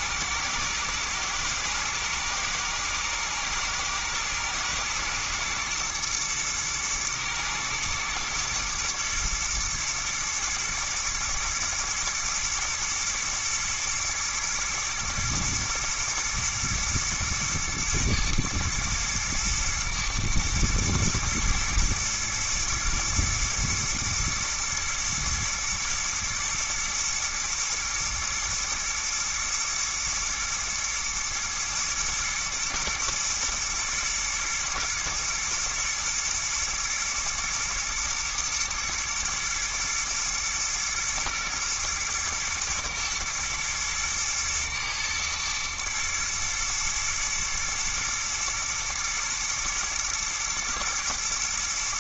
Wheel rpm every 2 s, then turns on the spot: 110, 120, 110, 110, 120, 120, 120, 110, 110, 110, 110, 110, 110, 120, 110, 110, 120, 110, 120, 110, 120, 110, 110, 120, 120, 110.
none